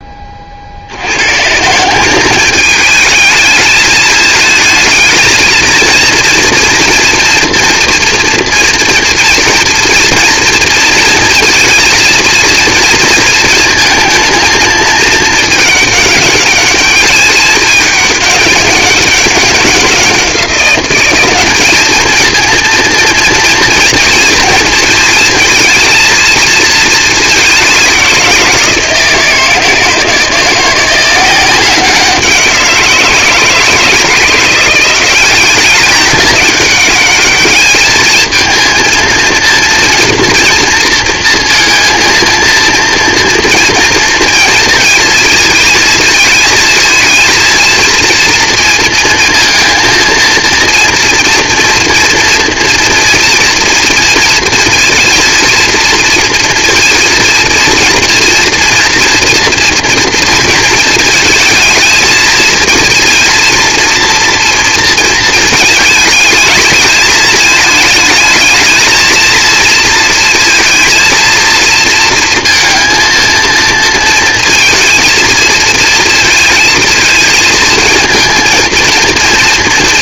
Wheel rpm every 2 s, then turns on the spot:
30, 210, 220, 240, 230, 230, 240, 220, 210, 200, 180, 230, 220, 220, 180, 170, 180, 170, 200, 230, 230, 230, 230, 220, 230, 230, 230, 230, 230, 230, 220, 230, 230, 220, 220, 230, 230, 230, 230, 230.
none